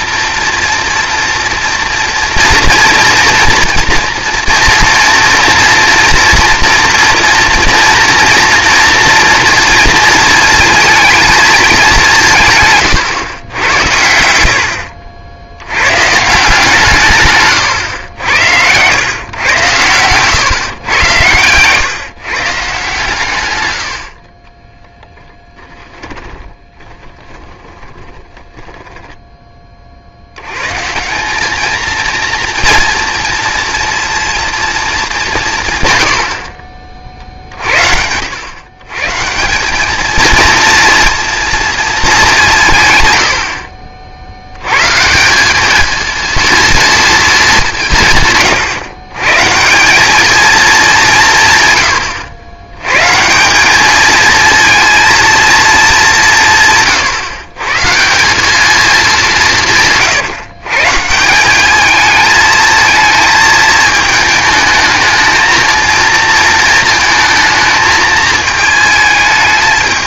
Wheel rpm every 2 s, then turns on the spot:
230, 240, 230, 240, 240, 230, 150, 70, 160, 100, 130, 140, 30, 20, 10, 120, 240, 230, 50, 110, 230, 160, 100, 230, 130, 220, 100, 230, 150, 210, 140, 220, 210, 220, 220.
24-30